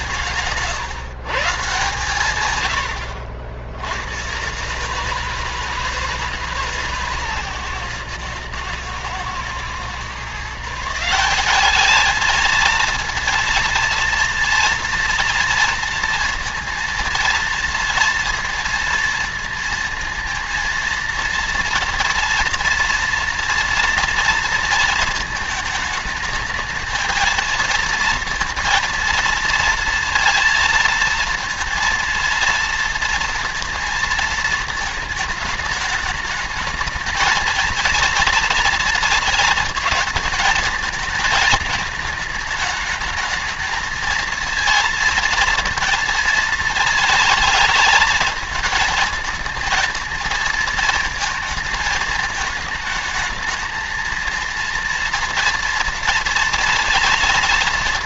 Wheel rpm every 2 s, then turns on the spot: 140, 100, 140, 150, 110, 160, 220, 230, 230, 230, 230, 230, 220, 220, 230, 230, 230, 220, 220, 230, 220, 210, 230, 220, 220, 230, 220, 230, 230.
none